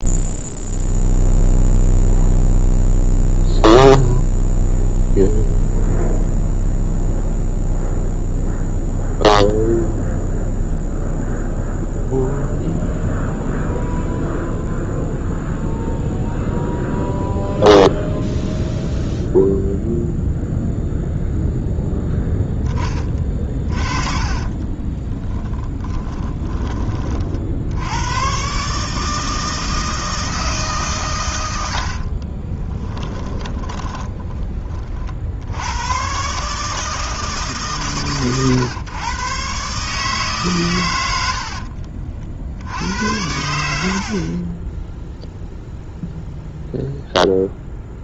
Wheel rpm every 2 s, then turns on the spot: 0, 0, 0, 0, 0, 0, 0, 0, 0, 0, 0, 10, 20, 30, 150, 150, 20, 30, 150, 120, 120, 80, 10, 0.
24-26 32-34